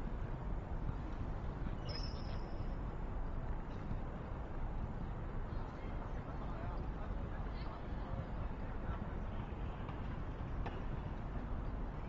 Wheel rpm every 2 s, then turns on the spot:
0, 0, 0, 0, 0, 0.
none